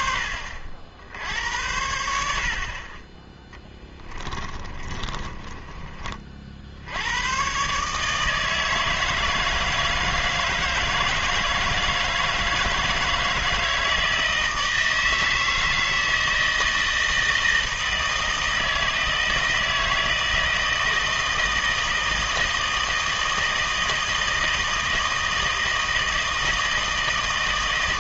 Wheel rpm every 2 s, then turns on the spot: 70, 50, 20, 60, 160, 160, 160, 160, 160, 160, 160, 160, 160, 160.
4-6